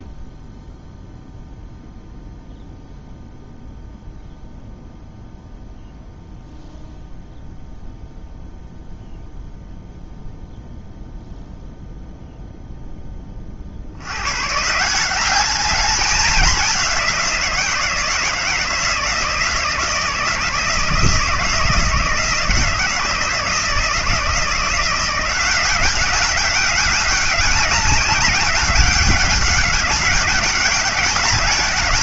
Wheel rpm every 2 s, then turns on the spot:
0, 0, 0, 0, 0, 0, 0, 130, 200, 170, 160, 160, 170, 200, 200, 200.
none